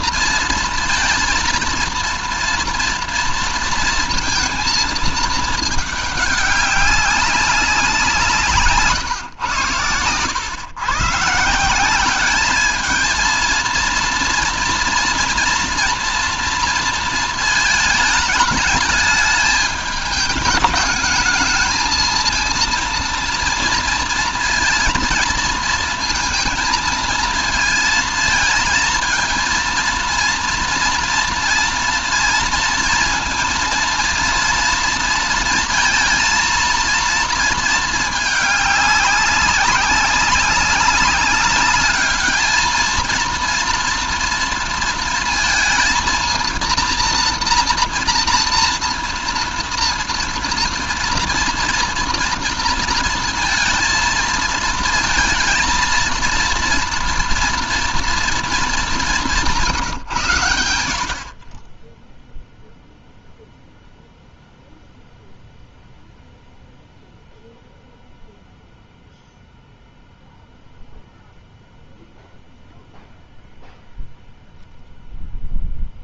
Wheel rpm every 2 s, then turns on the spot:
230, 230, 220, 200, 140, 130, 220, 230, 230, 220, 220, 230, 230, 230, 230, 230, 230, 230, 230, 200, 200, 220, 230, 230, 240, 240, 230, 220, 230, 200, 70, 0, 0, 0, 0, 0, 0, 0.
none